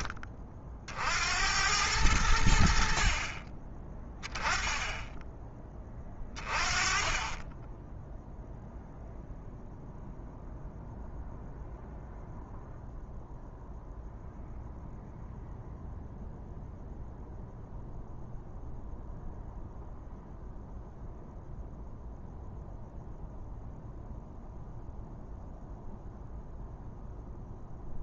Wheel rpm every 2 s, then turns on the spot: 50, 60, 10, 20, 0, 0, 0, 0, 0, 0, 0, 0, 0, 0.
none